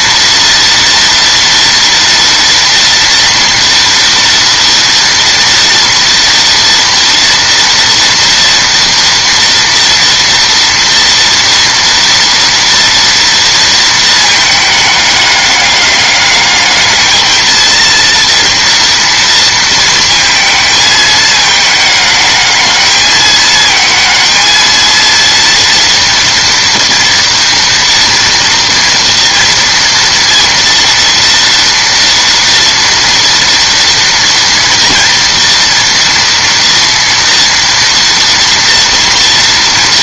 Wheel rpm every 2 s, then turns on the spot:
230, 230, 230, 230, 230, 230, 230, 210, 210, 230, 220, 210, 230, 230, 230, 230, 230, 230, 230, 230.
none